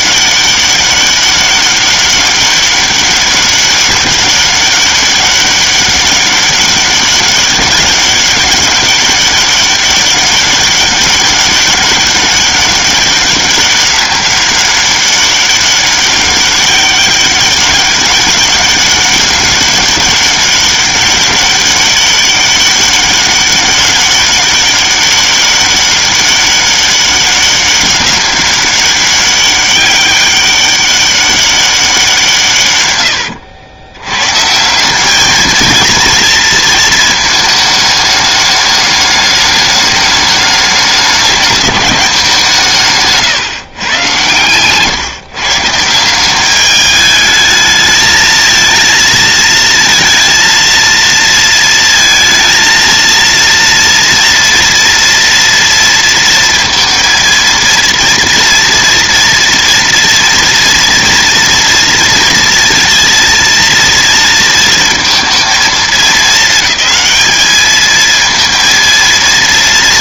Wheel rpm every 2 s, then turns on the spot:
200, 200, 200, 200, 200, 200, 200, 200, 200, 200, 200, 200, 200, 200, 200, 200, 130, 160, 230, 210, 210, 170, 130, 210, 220, 230, 230, 230, 230, 230, 230, 230, 230, 220, 230.
none